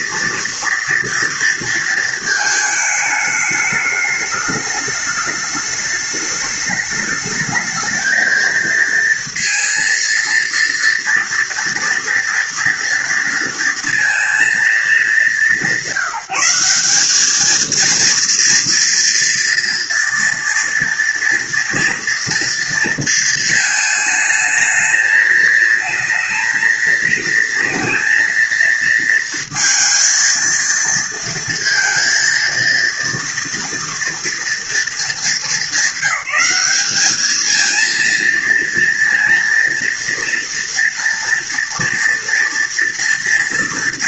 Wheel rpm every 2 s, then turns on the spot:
230, 220, 210, 210, 230, 230, 230, 200, 200, 230, 230, 230, 220, 230, 230, 230, 230, 220, 210, 230, 240, 230.
none